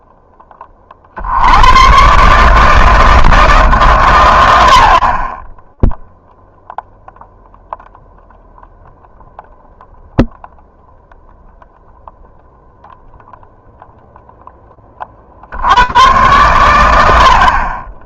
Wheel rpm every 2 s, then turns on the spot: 40, 160, 50, 0, 0, 0, 0, 20, 80.
none